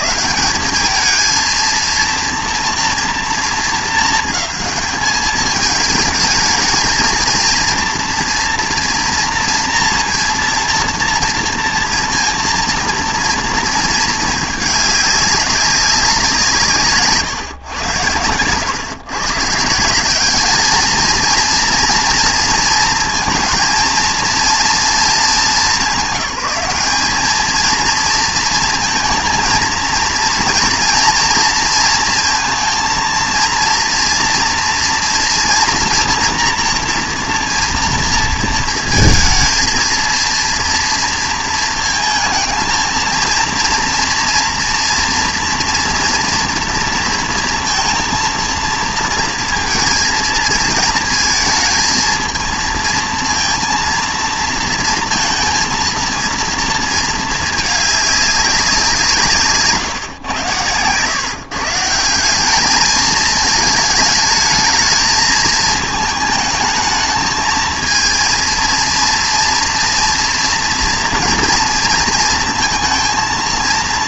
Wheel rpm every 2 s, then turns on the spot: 190, 240, 220, 220, 240, 230, 230, 210, 170, 110, 210, 230, 230, 190, 230, 230, 230, 230, 240, 230, 230, 220, 230, 230, 230, 220, 230, 230, 230, 190, 110, 210, 220, 220, 230, 230, 230.
none